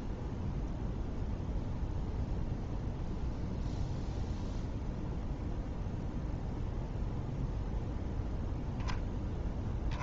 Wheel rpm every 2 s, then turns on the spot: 0, 0, 0, 0, 0.
none